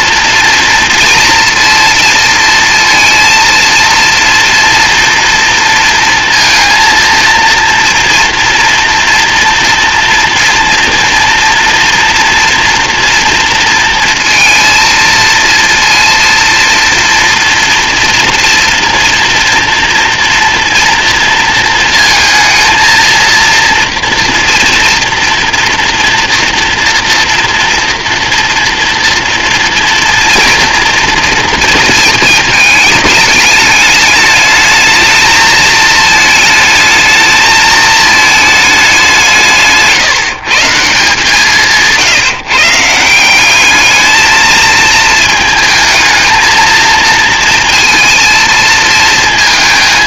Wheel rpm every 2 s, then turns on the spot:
230, 230, 230, 230, 230, 230, 230, 230, 230, 230, 230, 230, 230, 230, 230, 240, 220, 220, 220, 210, 160, 150, 220, 230, 230.
none